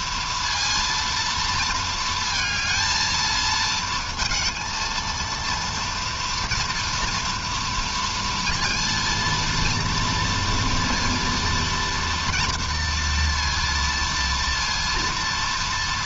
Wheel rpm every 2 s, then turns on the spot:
230, 220, 230, 230, 230, 230, 230, 230.
none